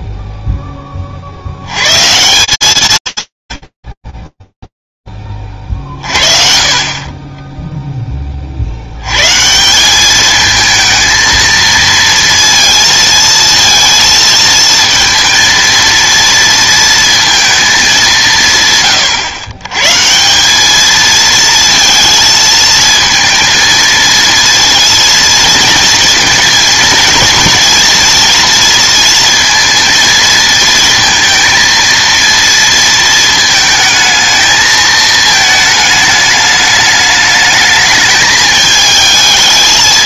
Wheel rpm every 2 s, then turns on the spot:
20, 160, 0, 40, 60, 220, 230, 230, 230, 140, 210, 230, 230, 230, 230, 230, 230, 220, 210, 220.
none